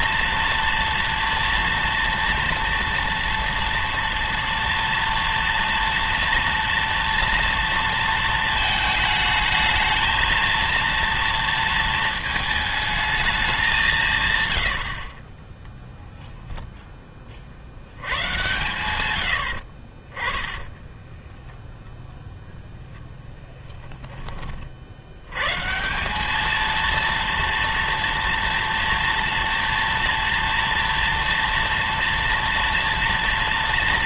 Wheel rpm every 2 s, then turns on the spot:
230, 230, 230, 230, 220, 230, 220, 80, 0, 110, 10, 0, 40, 220, 230, 230, 230.
20-22